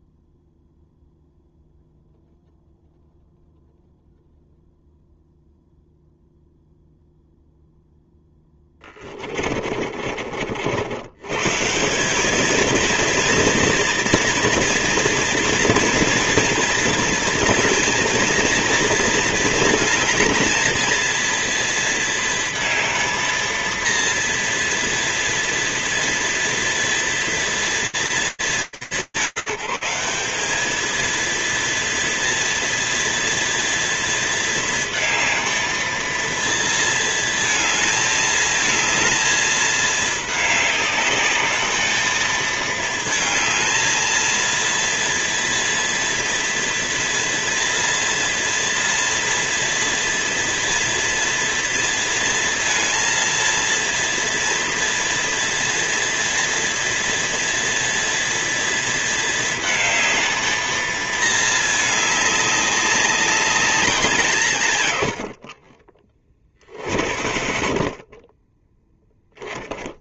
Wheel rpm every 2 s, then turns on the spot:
0, 0, 0, 0, 20, 70, 230, 230, 230, 220, 220, 230, 230, 230, 210, 200, 230, 230, 230, 220, 210, 220, 230, 230, 230, 240, 230, 230, 230, 230, 220, 200, 100, 50, 0.
8-10 66-68